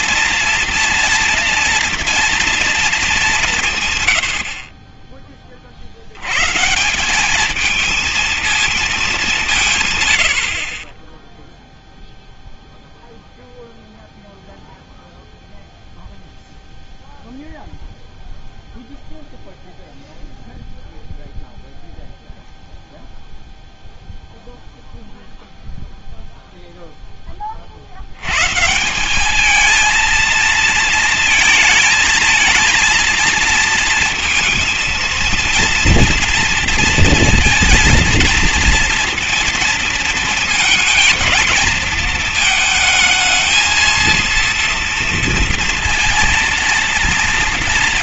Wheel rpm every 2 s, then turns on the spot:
230, 230, 40, 140, 220, 40, 0, 0, 0, 0, 0, 0, 0, 0, 140, 230, 230, 230, 230, 230, 230, 220, 230, 230.
none